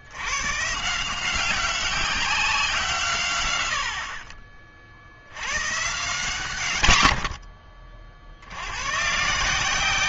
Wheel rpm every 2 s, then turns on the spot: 150, 150, 50, 80, 110.
6-8